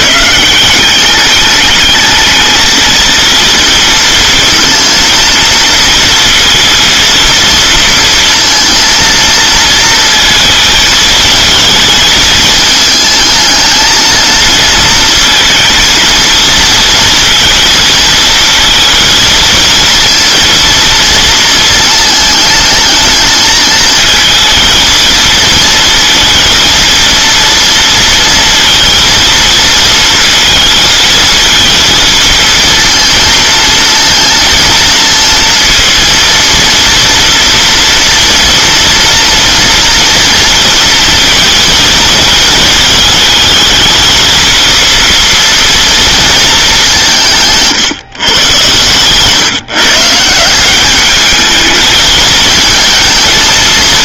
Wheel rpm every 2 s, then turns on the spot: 180, 220, 230, 230, 230, 220, 220, 230, 230, 230, 230, 220, 220, 230, 230, 230, 230, 230, 230, 230, 230, 220, 230, 190, 120, 190, 220.
none